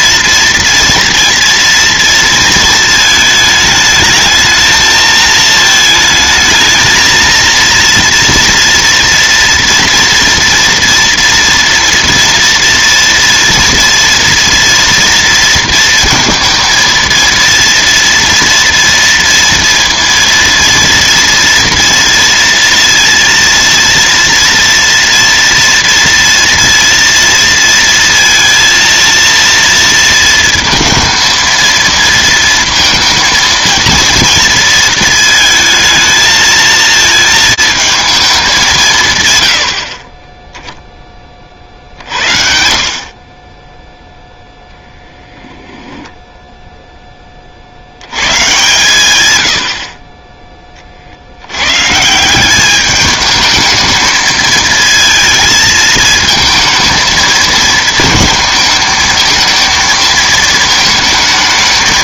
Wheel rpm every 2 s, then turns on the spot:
230, 220, 220, 220, 230, 230, 230, 230, 230, 230, 230, 230, 230, 230, 230, 230, 230, 230, 220, 190, 10, 50, 0, 0, 120, 20, 190, 220, 220, 220, 220.
none